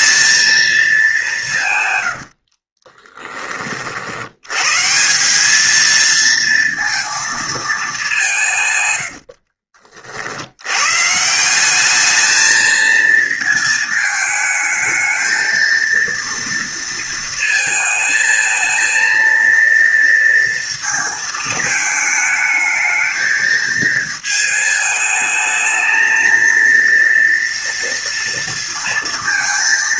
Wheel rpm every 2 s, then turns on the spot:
210, 30, 150, 230, 100, 120, 220, 220, 230, 230, 230, 220, 220, 230, 230.
2-4 8-10